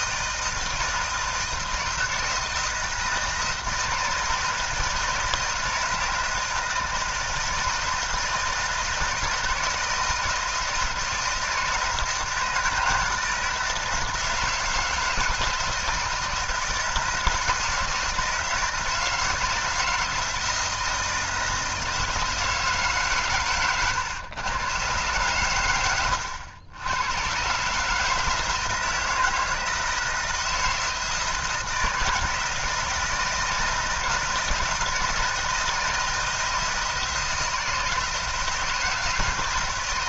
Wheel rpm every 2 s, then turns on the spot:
160, 160, 160, 160, 160, 160, 170, 160, 160, 160, 170, 150, 110, 90, 160, 160, 160, 160, 160, 160.
none